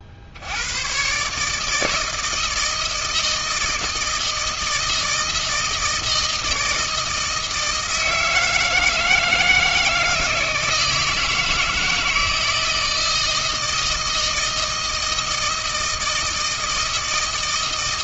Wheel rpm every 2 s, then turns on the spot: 120, 160, 160, 160, 160, 160, 160, 160, 160.
none